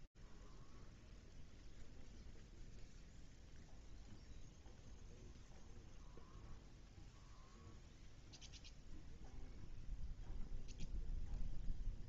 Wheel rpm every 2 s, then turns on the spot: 0, 0, 0, 0, 0, 0.
none